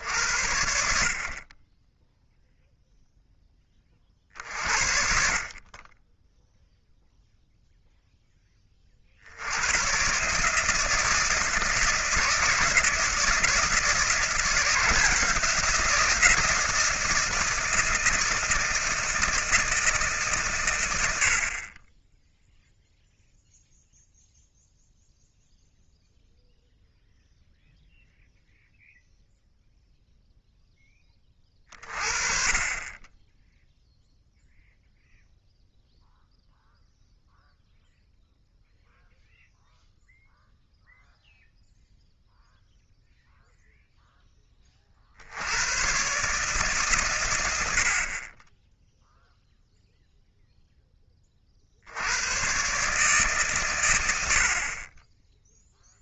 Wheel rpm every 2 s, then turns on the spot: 70, 0, 50, 0, 30, 150, 160, 170, 170, 160, 120, 0, 0, 0, 0, 10, 20, 0, 0, 0, 0, 0, 30, 130, 0, 10, 130, 40.
none